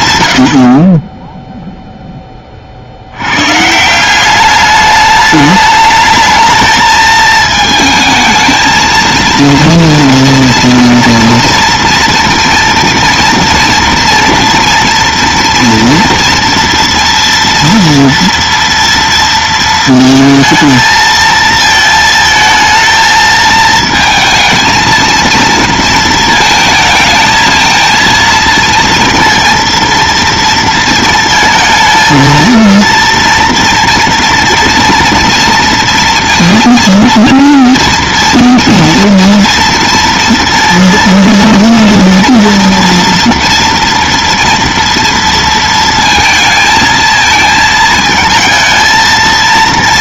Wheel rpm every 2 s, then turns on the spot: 70, 40, 200, 220, 220, 230, 230, 230, 230, 230, 220, 220, 220, 220, 230, 220, 230, 230, 230, 230, 230, 230, 230, 220, 230.
none